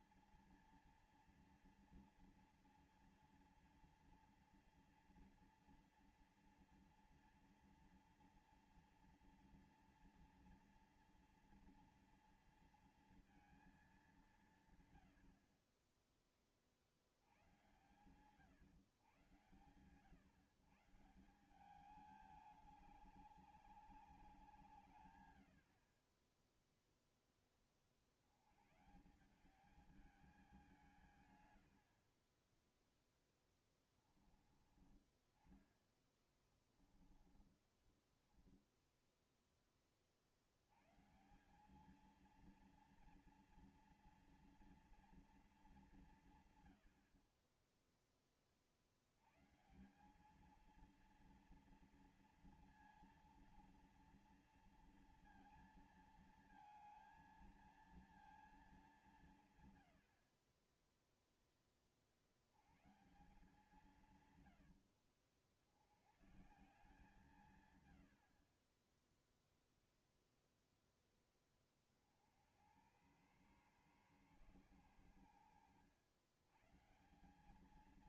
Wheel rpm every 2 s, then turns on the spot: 240, 240, 230, 230, 230, 230, 230, 150, 30, 140, 130, 210, 160, 10, 100, 180, 20, 20, 20, 10, 80, 220, 230, 120, 40, 210, 230, 230, 230, 220, 40, 90, 100, 130, 40, 0, 70, 120, 110.
26-28 36-38 64-66